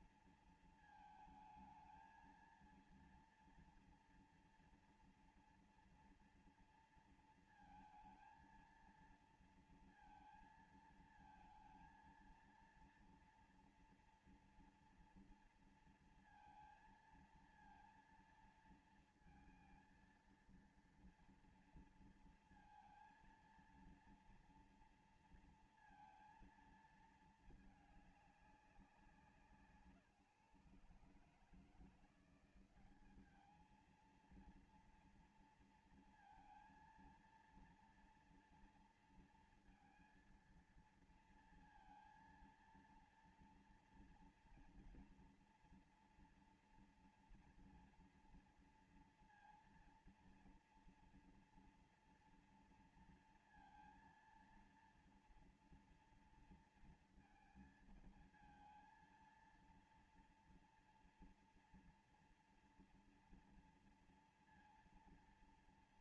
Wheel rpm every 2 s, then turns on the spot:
230, 230, 230, 230, 230, 230, 230, 240, 230, 230, 230, 230, 230, 230, 200, 140, 180, 230, 230, 230, 230, 230, 230, 240, 230, 230, 230, 230, 230, 230, 230, 230, 230.
none